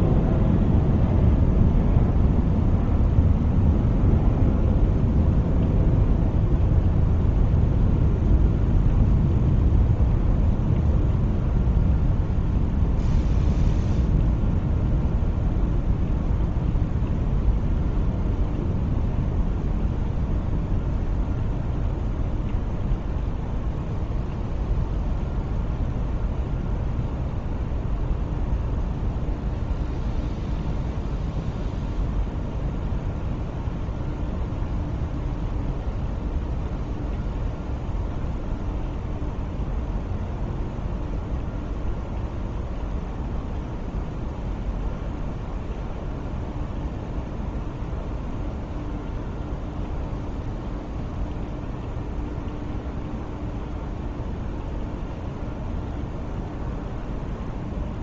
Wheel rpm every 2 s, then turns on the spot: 0, 0, 0, 0, 0, 0, 0, 0, 0, 0, 0, 0, 0, 0, 0, 0, 0, 0, 0, 0, 0, 0, 0, 0, 0, 0, 0, 0, 0.
none